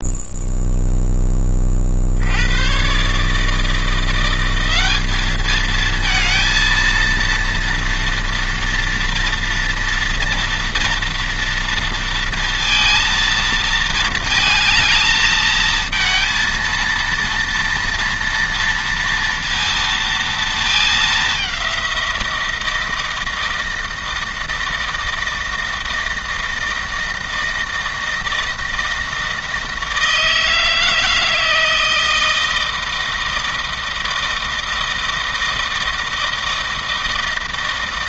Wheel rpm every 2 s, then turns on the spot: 10, 140, 200, 230, 230, 230, 230, 220, 230, 230, 220, 160, 160, 160, 160, 160, 160, 160, 160.
none